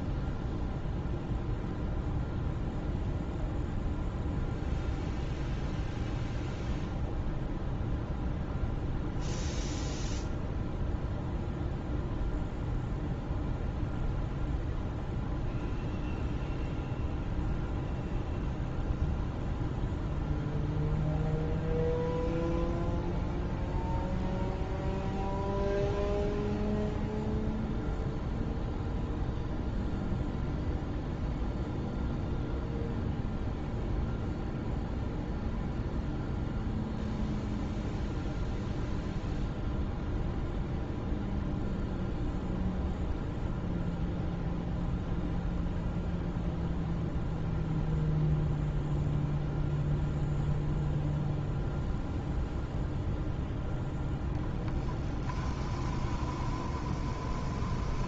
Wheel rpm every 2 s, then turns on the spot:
0, 0, 0, 0, 0, 0, 0, 0, 0, 0, 0, 0, 0, 0, 0, 0, 0, 0, 0, 0, 0, 0, 0, 0, 0, 0, 0, 10, 20.
54-58